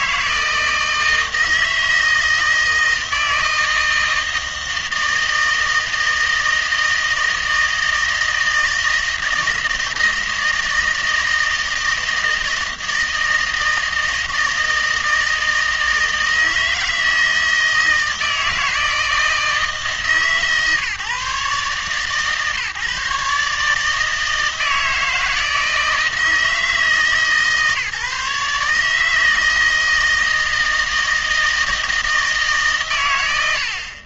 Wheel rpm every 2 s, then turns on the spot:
160, 160, 160, 160, 160, 160, 160, 160, 160, 160, 140, 140, 160, 160, 150, 160, 150.
none